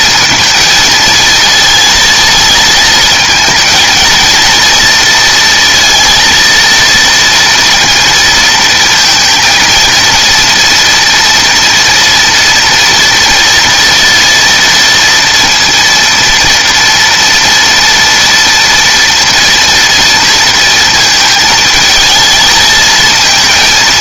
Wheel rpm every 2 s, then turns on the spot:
230, 220, 230, 230, 230, 230, 240, 230, 230, 230, 230, 220.
none